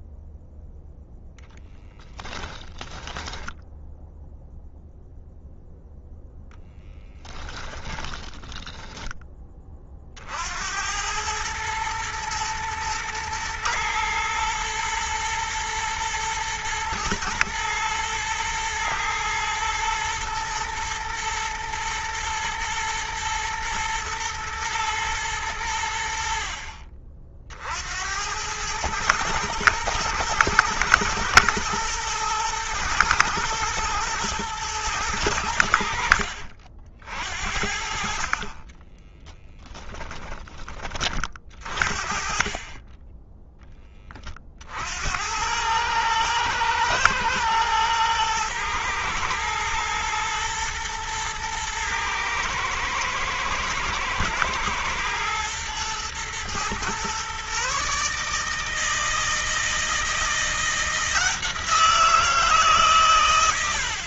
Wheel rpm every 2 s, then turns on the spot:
0, 10, 0, 10, 10, 90, 110, 120, 120, 110, 120, 120, 110, 50, 110, 120, 120, 100, 50, 10, 30, 20, 70, 110, 110, 110, 120, 110, 120, 160, 170, 140.
2-4 6-10 38-40